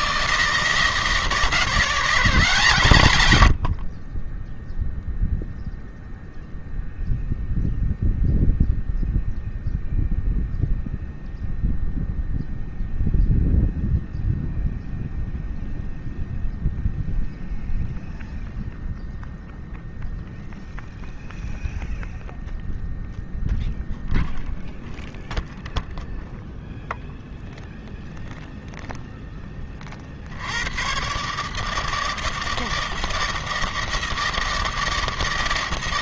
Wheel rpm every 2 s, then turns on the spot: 160, 120, 0, 0, 0, 0, 0, 0, 0, 0, 0, 0, 0, 0, 0, 110, 160, 160.
none